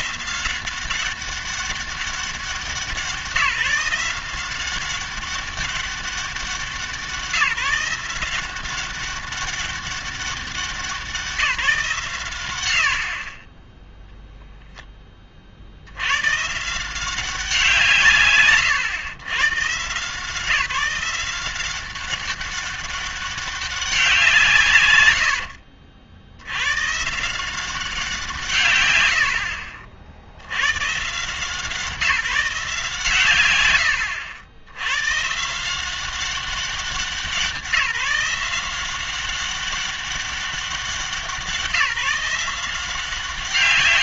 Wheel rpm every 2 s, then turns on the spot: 190, 180, 190, 180, 190, 190, 110, 10, 160, 130, 180, 200, 110, 120, 130, 120, 160, 100, 190, 180, 190, 180.
none